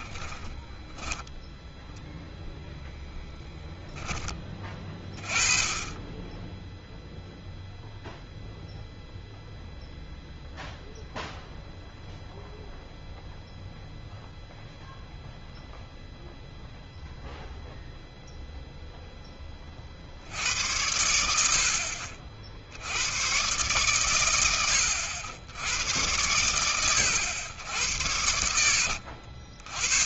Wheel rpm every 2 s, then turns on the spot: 10, 10, 20, 10, 0, 0, 0, 0, 0, 0, 90, 70, 90, 100, 80.
0-2